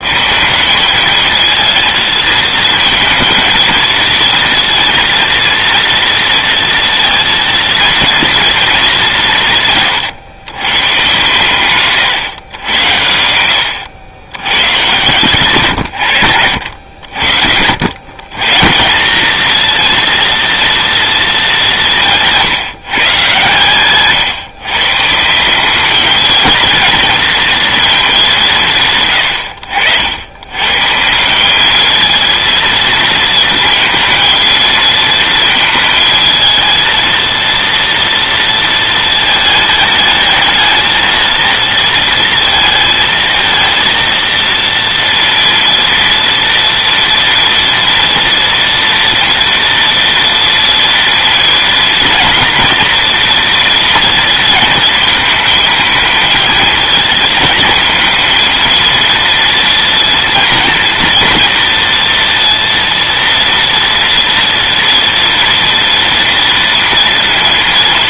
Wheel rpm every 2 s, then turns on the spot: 190, 230, 230, 230, 210, 110, 110, 120, 80, 160, 230, 170, 140, 230, 160, 120, 230, 230, 220, 230, 220, 230, 230, 230, 230, 240, 230, 230, 220, 230, 230, 230, 240, 230.
none